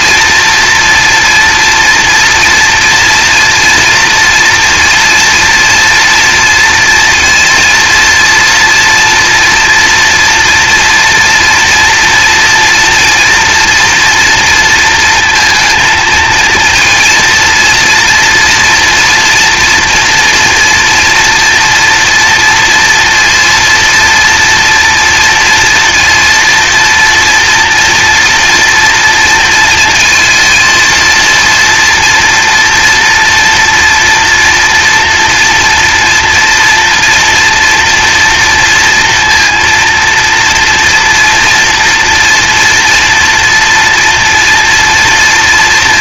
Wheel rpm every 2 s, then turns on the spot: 230, 240, 230, 230, 230, 230, 240, 230, 230, 230, 240, 230, 230, 230, 230, 230, 230, 230, 230, 230, 230, 230, 230.
none